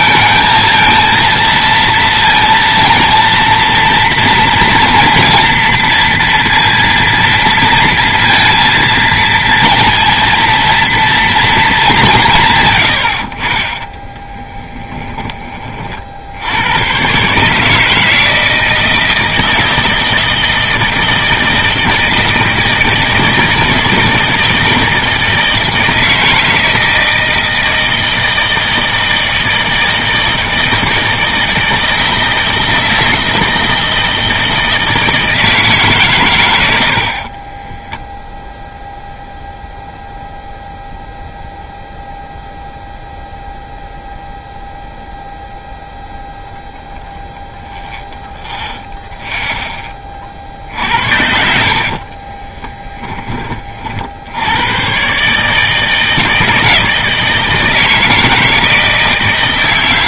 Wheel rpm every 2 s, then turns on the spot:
220, 230, 230, 230, 230, 230, 130, 30, 90, 160, 160, 160, 160, 160, 160, 160, 160, 160, 100, 0, 0, 0, 0, 0, 0, 50, 20, 90, 160, 160.
14-16 52-54